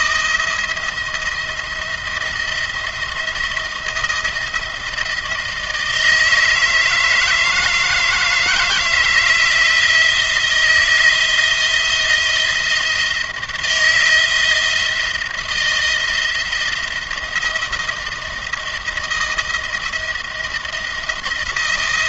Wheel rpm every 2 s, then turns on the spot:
170, 170, 170, 160, 160, 170, 170, 170, 170, 170, 170.
none